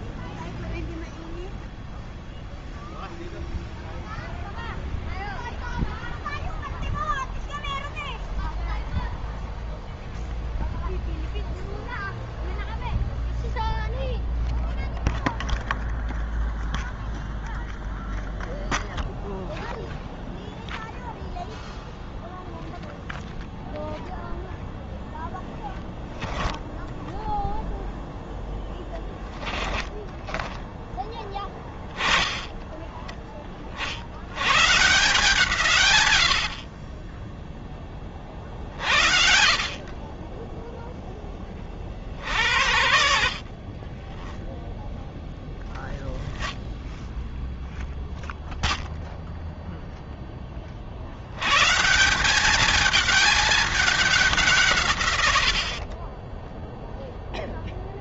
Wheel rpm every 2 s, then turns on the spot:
0, 0, 0, 0, 0, 0, 0, 0, 0, 0, 0, 0, 0, 0, 10, 20, 20, 130, 40, 50, 10, 70, 20, 0, 0, 10, 200, 170, 10.
none